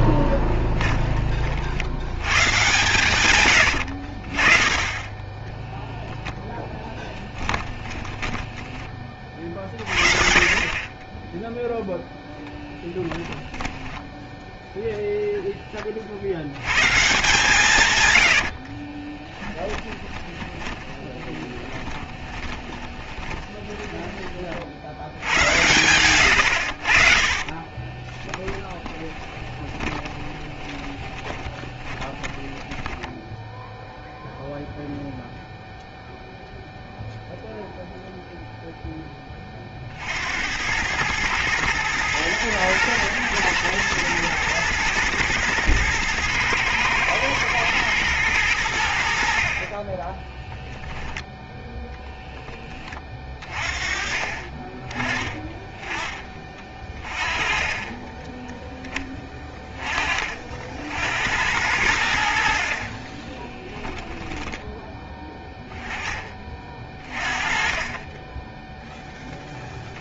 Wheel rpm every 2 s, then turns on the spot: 10, 110, 40, 0, 20, 30, 0, 10, 100, 70, 10, 20, 40, 90, 20, 20, 10, 0, 0, 0, 80, 120, 120, 120, 100, 10, 10, 30, 20, 10, 40, 60, 10, 20, 10.
0-2 8-10 18-24 28-34 64-66